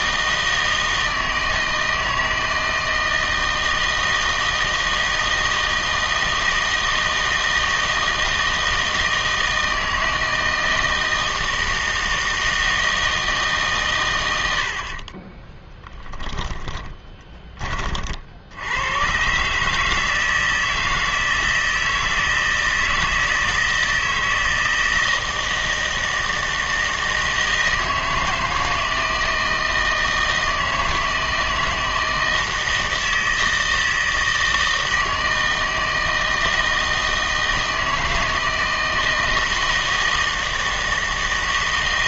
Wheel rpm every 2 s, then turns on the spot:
160, 160, 160, 160, 160, 160, 160, 70, 10, 90, 160, 160, 160, 160, 160, 160, 160, 160, 160, 160, 160.
16-18